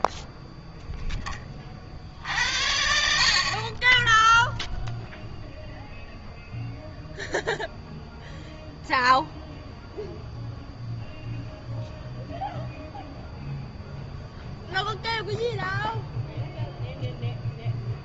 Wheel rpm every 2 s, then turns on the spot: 10, 70, 0, 0, 0, 0, 0, 0, 0.
none